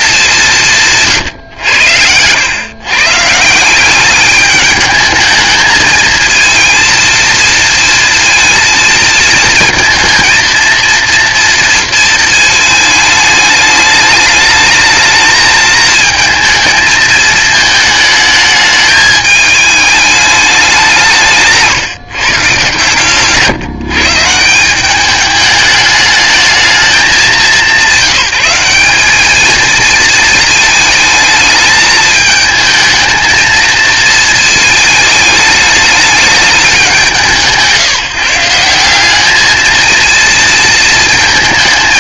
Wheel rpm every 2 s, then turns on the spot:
180, 120, 210, 230, 230, 230, 220, 210, 220, 210, 190, 130, 170, 200, 180, 220, 220, 220, 200, 170, 230.
none